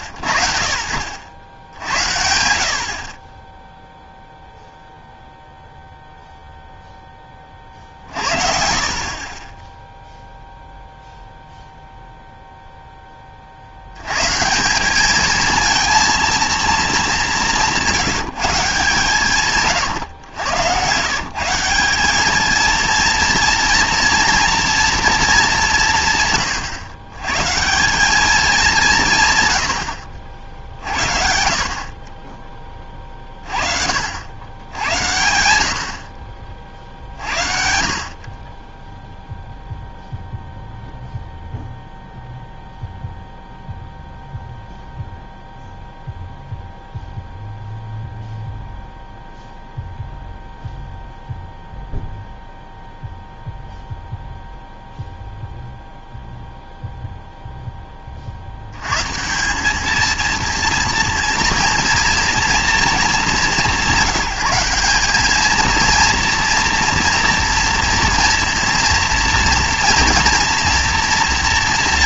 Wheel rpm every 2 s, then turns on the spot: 70, 40, 0, 20, 30, 0, 20, 210, 210, 140, 130, 230, 220, 120, 170, 50, 30, 90, 50, 0, 0, 0, 0, 0, 0, 0, 0, 0, 0, 130, 230, 210, 190, 230, 230, 230.
none